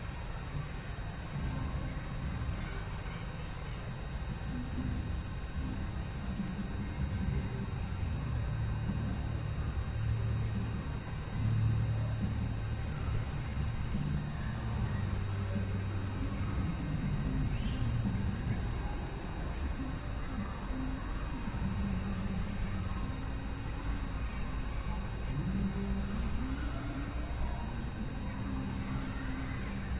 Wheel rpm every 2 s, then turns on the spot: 0, 0, 0, 0, 0, 0, 0, 0, 0, 0, 0, 0, 0, 0, 0.
none